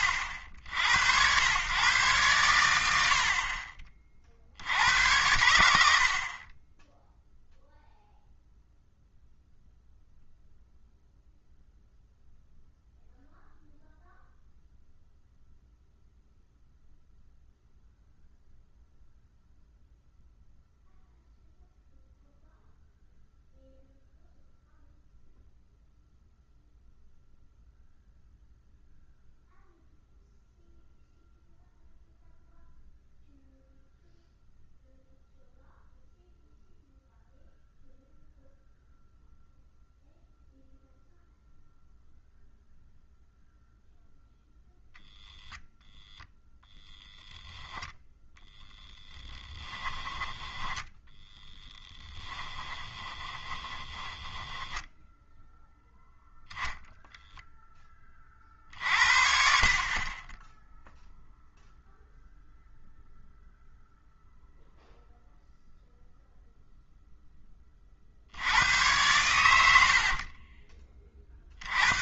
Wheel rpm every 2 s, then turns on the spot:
80, 90, 70, 20, 0, 0, 0, 0, 0, 0, 0, 0, 0, 0, 0, 0, 0, 0, 0, 0, 0, 0, 0, 0, 0, 10, 20, 10, 0, 50, 0, 0, 0, 0, 90, 20.
50-56 70-72